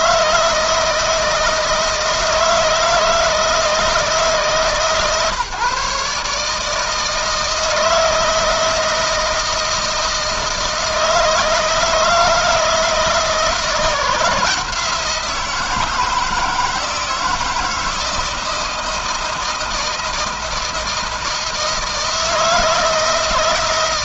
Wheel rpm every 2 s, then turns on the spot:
160, 160, 160, 150, 160, 160, 160, 170, 160, 160, 160, 160.
none